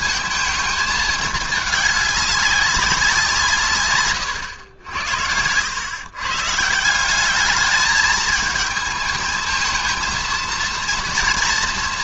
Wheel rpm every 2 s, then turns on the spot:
220, 200, 100, 140, 220, 230.
none